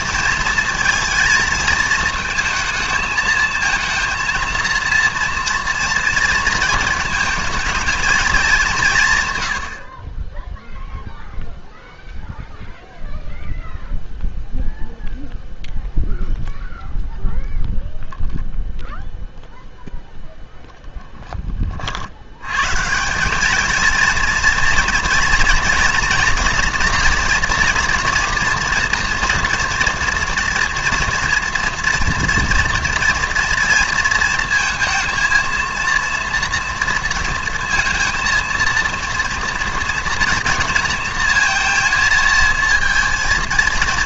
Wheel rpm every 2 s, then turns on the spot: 230, 230, 230, 230, 190, 0, 0, 0, 0, 0, 0, 120, 230, 230, 240, 240, 240, 230, 230, 230, 230, 230.
none